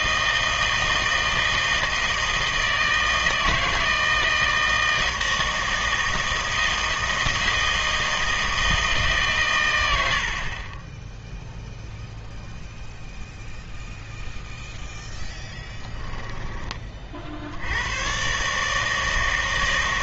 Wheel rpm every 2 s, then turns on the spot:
160, 160, 160, 160, 160, 30, 0, 0, 20, 150.
none